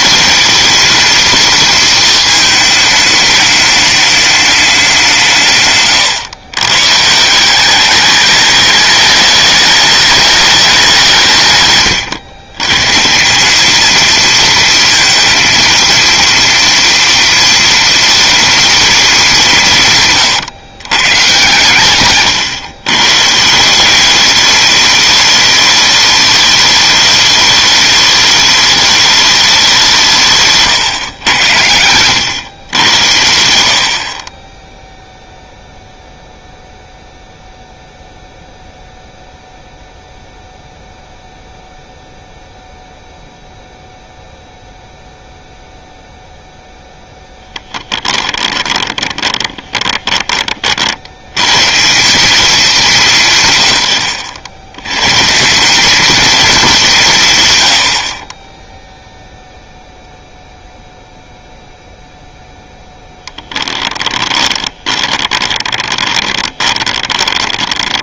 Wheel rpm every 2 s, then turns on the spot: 230, 220, 190, 130, 210, 180, 140, 230, 230, 230, 130, 130, 210, 210, 210, 130, 90, 0, 0, 0, 0, 0, 0, 0, 20, 50, 190, 110, 190, 10, 0, 0, 20, 20.
48-50 64-68